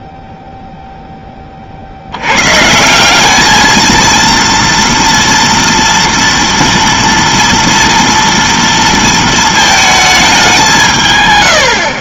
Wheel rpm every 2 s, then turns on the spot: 0, 100, 230, 230, 230, 210.
none